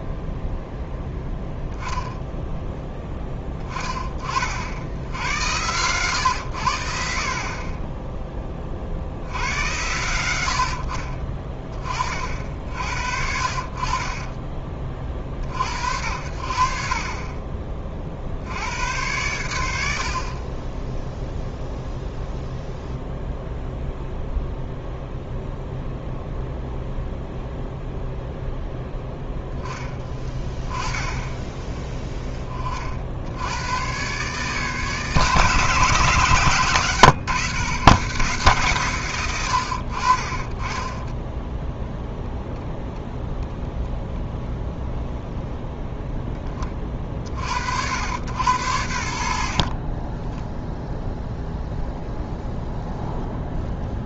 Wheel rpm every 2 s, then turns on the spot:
0, 10, 90, 80, 50, 60, 60, 30, 50, 90, 20, 0, 0, 0, 0, 10, 40, 150, 130, 130, 20, 0, 0, 20, 70, 0, 0.
40-42